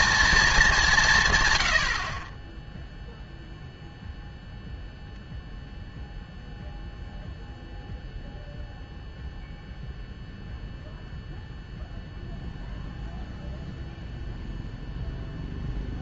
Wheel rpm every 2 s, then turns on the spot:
210, 10, 0, 0, 0, 0, 0, 0.
none